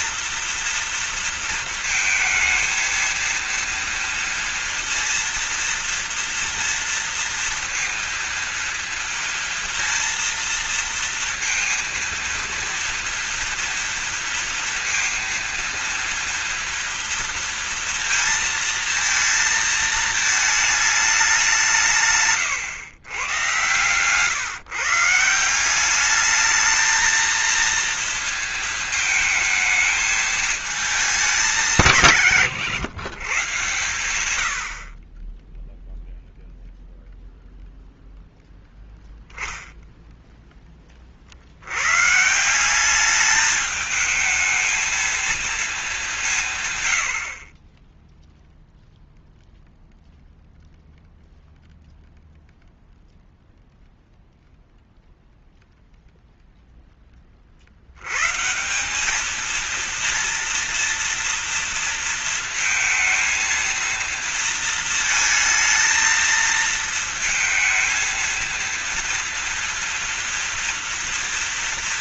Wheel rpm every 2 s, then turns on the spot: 230, 220, 230, 230, 230, 230, 230, 230, 230, 230, 220, 110, 150, 220, 220, 220, 120, 60, 0, 0, 20, 190, 220, 140, 0, 0, 0, 0, 0, 180, 230, 230, 220, 230, 230, 230.
none